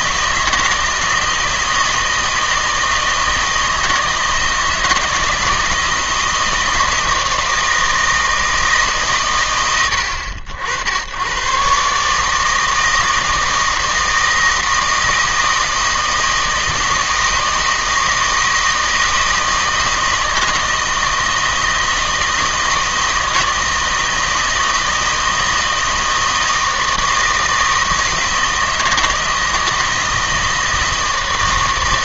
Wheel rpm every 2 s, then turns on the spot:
160, 160, 160, 160, 160, 80, 160, 160, 160, 160, 160, 160, 160, 160, 160, 160.
none